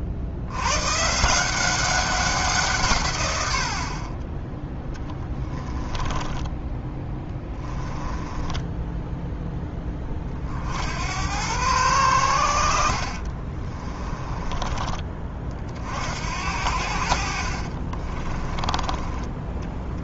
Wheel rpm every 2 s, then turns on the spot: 130, 150, 10, 20, 10, 70, 60, 20, 60, 20.
4-10